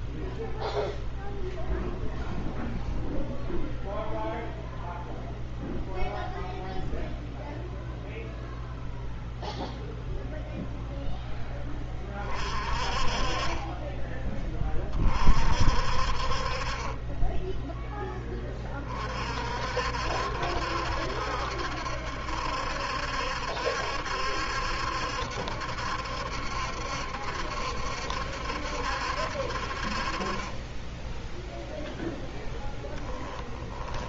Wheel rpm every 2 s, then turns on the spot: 0, 0, 0, 0, 0, 0, 30, 30, 30, 40, 70, 70, 70, 70, 70, 20, 10.
32-34